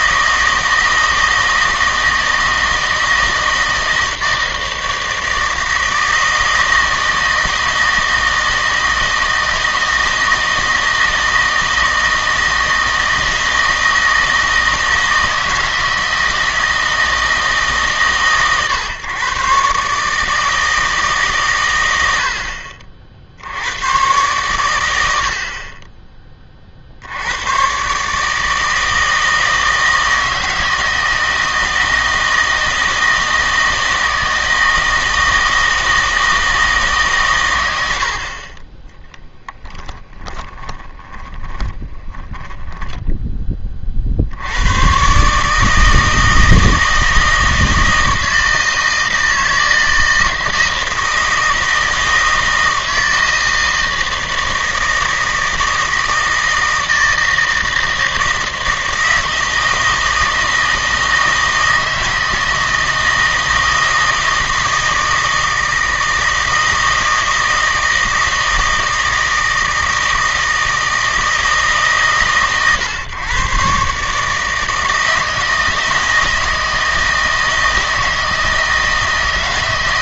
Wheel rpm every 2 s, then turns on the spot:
160, 160, 160, 160, 160, 160, 160, 160, 160, 130, 160, 50, 100, 50, 160, 160, 160, 160, 150, 20, 20, 10, 110, 160, 160, 160, 160, 160, 160, 160, 160, 160, 160, 160, 160, 160, 130, 160, 160, 160.
40-44